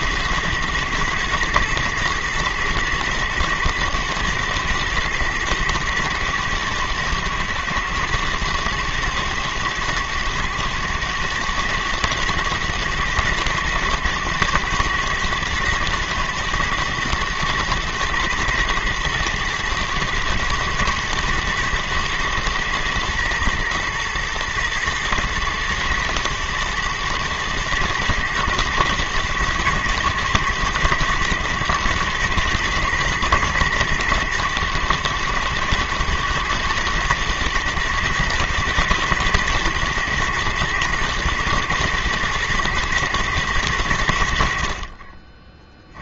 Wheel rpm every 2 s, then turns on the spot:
110, 110, 120, 110, 110, 110, 110, 120, 120, 110, 110, 110, 120, 110, 110, 110, 110, 110, 110, 120, 110, 120, 60.
none